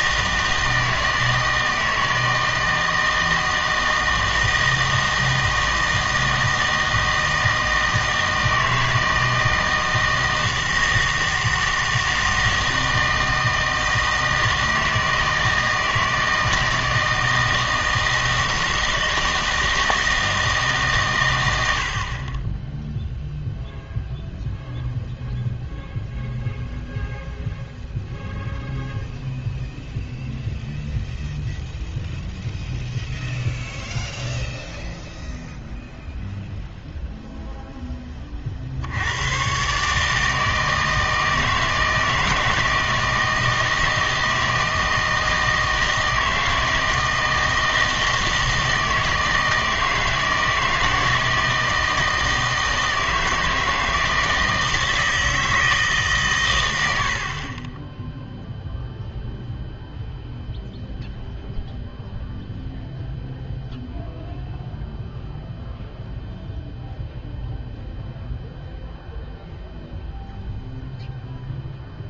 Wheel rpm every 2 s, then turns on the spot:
160, 160, 160, 160, 160, 160, 160, 160, 160, 160, 160, 20, 0, 0, 0, 0, 0, 0, 0, 50, 160, 160, 160, 160, 160, 160, 160, 160, 100, 0, 0, 0, 0, 0, 0, 0.
none